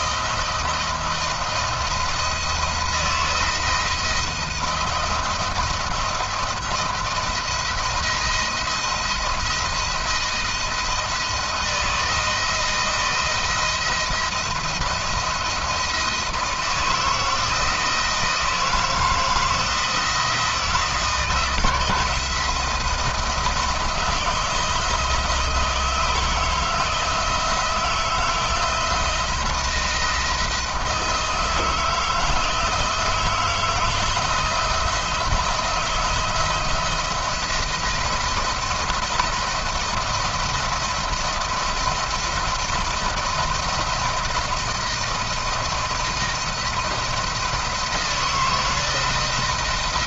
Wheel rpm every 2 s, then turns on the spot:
170, 160, 170, 170, 170, 160, 170, 170, 160, 160, 170, 170, 160, 160, 170, 170, 160, 170, 160, 170, 170, 170, 170, 170, 170.
none